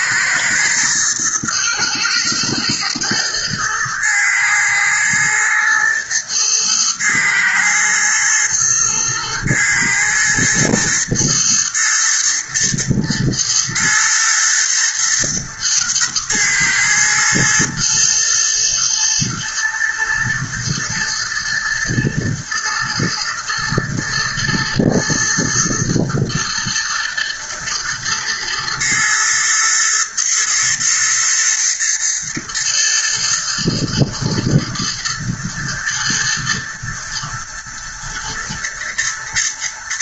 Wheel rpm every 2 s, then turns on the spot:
110, 120, 110, 110, 110, 110, 110, 120, 110, 110, 110, 110, 110, 120, 110, 110, 110, 120, 120, 110.
none